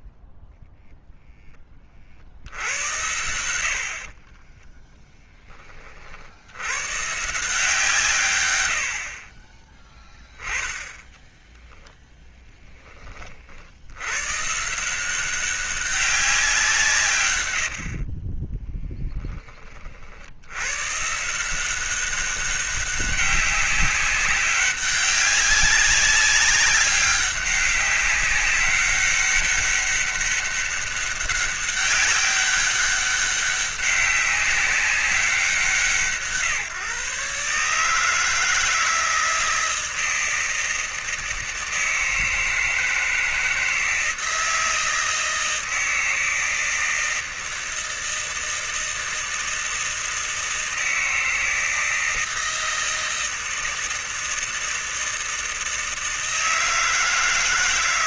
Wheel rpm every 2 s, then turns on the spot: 0, 80, 20, 110, 90, 10, 10, 160, 180, 20, 100, 190, 190, 200, 200, 200, 200, 200, 150, 160, 160, 160, 160, 160, 160, 160, 160, 160, 160.
4-6 18-20